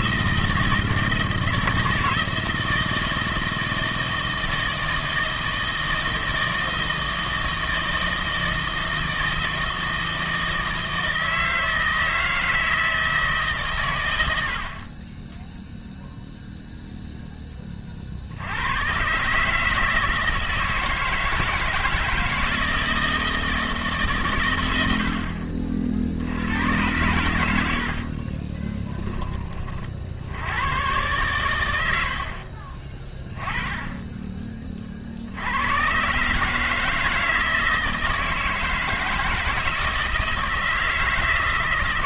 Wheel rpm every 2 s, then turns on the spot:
160, 160, 160, 160, 160, 160, 160, 70, 0, 90, 160, 160, 110, 100, 20, 100, 40, 30, 160, 160, 160.
28-30 32-34